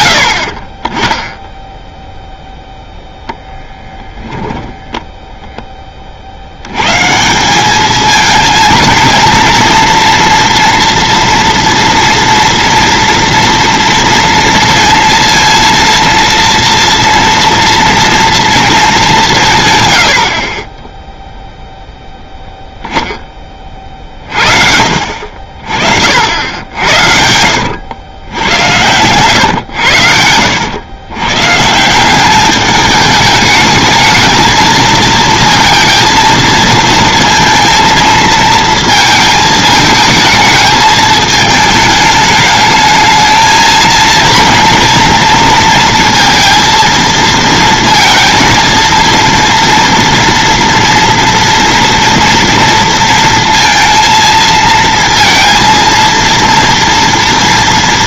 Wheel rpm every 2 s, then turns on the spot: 30, 0, 0, 120, 230, 230, 240, 230, 230, 210, 10, 0, 50, 80, 100, 110, 210, 220, 230, 230, 220, 220, 230, 230, 230, 230, 230, 220, 240.
none